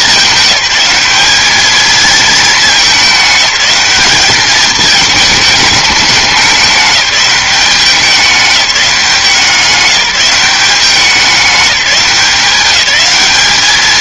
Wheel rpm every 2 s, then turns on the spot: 200, 210, 210, 200, 200, 190, 190.
none